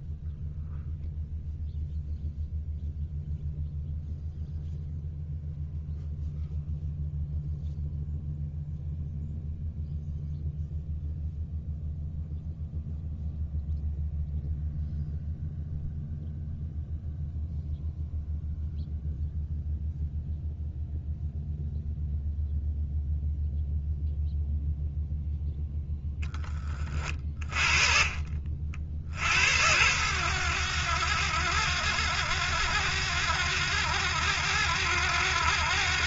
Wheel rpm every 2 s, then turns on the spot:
0, 0, 0, 0, 0, 0, 0, 0, 0, 0, 0, 0, 0, 20, 50, 70, 70, 70.
26-28